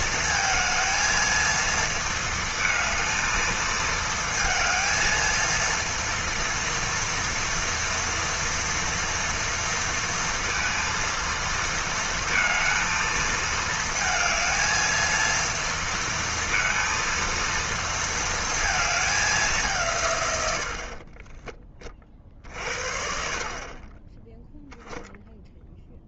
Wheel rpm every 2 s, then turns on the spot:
220, 220, 220, 230, 230, 230, 230, 220, 230, 220, 80, 50, 0.
none